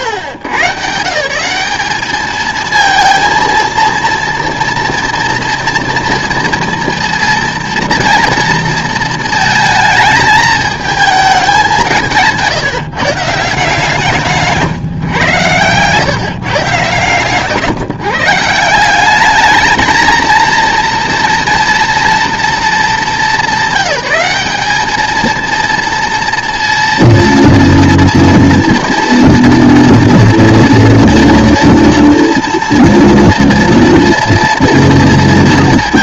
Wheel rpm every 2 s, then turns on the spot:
120, 220, 230, 230, 230, 220, 160, 160, 140, 170, 230, 220, 200, 230, 230, 230, 230, 230.
none